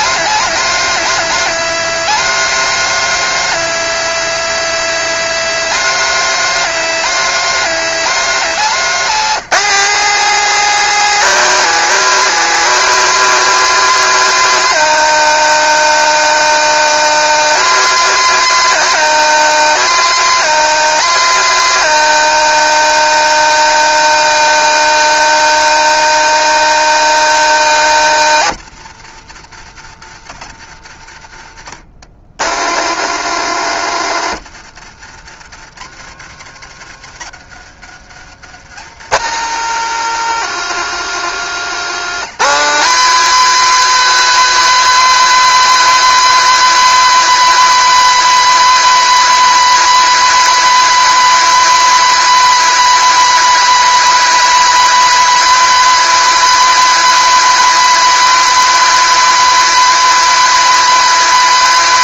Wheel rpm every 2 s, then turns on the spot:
230, 230, 240, 230, 210, 230, 230, 230, 230, 230, 230, 220, 220, 220, 120, 90, 210, 130, 120, 190, 210, 220, 230, 230, 230, 230, 230, 230, 230, 230, 230.
none